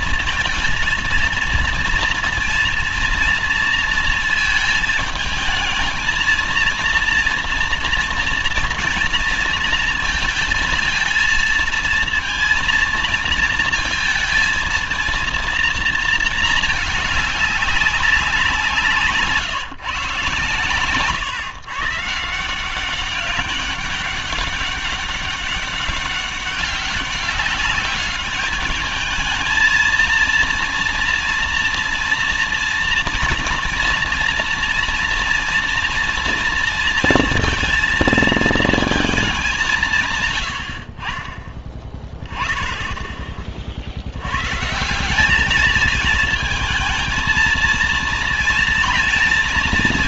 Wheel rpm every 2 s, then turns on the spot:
230, 240, 220, 230, 240, 230, 230, 220, 220, 180, 130, 170, 200, 200, 210, 230, 230, 240, 230, 220, 120, 20, 120, 220, 230.
none